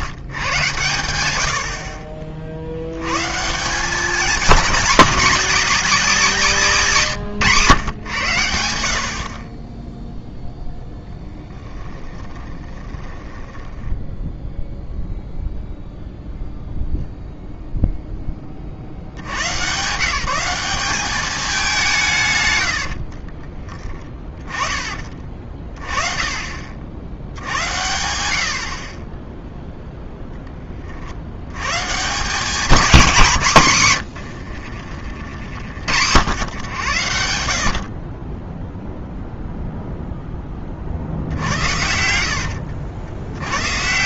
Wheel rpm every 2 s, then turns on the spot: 170, 70, 190, 270, 120, 10, 20, 10, 0, 0, 170, 160, 20, 30, 90, 0, 140, 130, 90, 30, 10, 70.
12-16 42-44